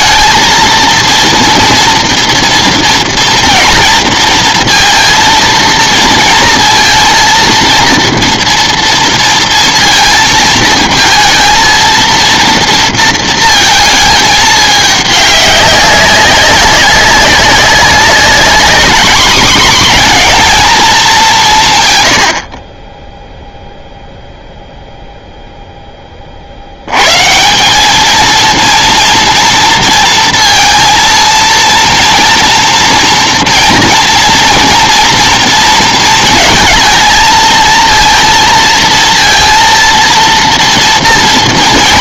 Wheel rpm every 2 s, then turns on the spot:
230, 230, 230, 230, 230, 220, 230, 210, 190, 210, 230, 50, 0, 50, 230, 230, 230, 240, 220, 230, 230.
none